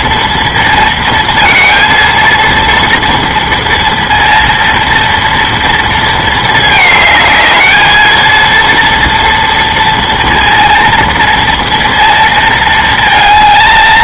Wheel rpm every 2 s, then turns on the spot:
230, 230, 230, 220, 230, 230, 220.
none